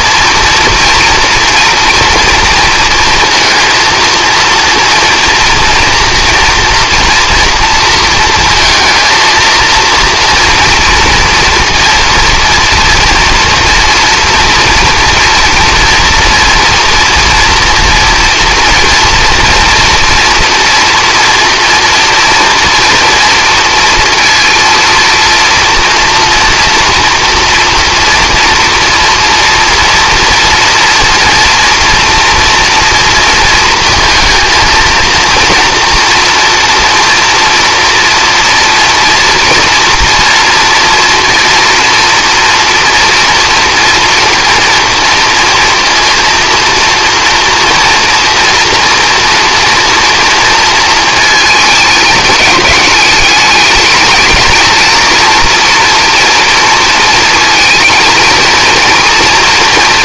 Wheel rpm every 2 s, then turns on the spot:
230, 230, 230, 230, 230, 230, 230, 230, 240, 230, 230, 230, 230, 230, 240, 230, 230, 220, 230, 230, 230, 230, 230, 230, 230, 230, 210, 230, 230, 230.
none